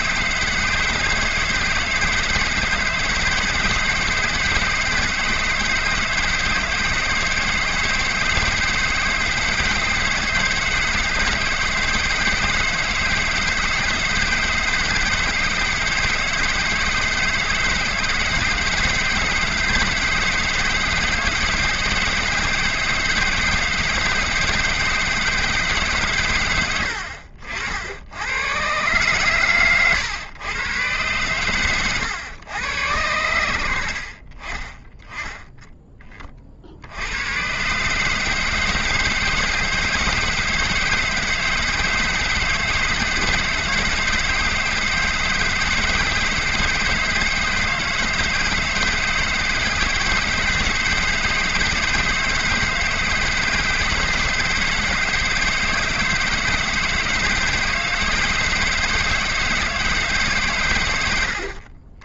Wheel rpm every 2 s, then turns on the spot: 160, 150, 160, 160, 160, 160, 160, 160, 160, 150, 160, 160, 160, 110, 120, 120, 100, 20, 60, 160, 160, 160, 160, 160, 160, 160, 160, 160, 160, 160, 120.
none